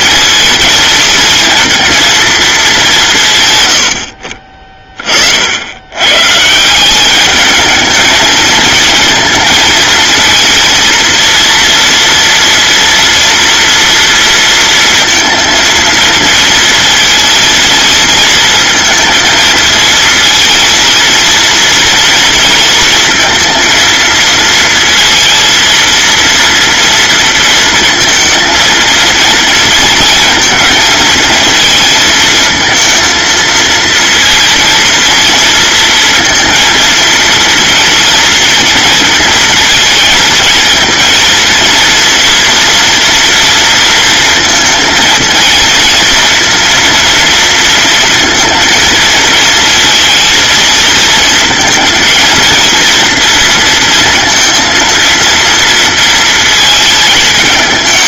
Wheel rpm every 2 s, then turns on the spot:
220, 200, 30, 160, 230, 230, 230, 230, 230, 230, 220, 230, 230, 230, 230, 220, 230, 230, 230, 230, 220, 230, 230, 230, 230, 230, 230, 230, 220.
none